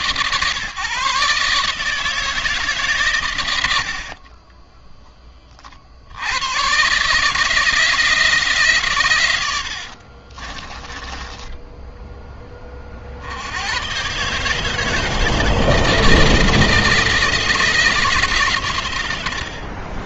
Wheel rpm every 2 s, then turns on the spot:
150, 140, 20, 130, 120, 20, 50, 160, 160, 120.
none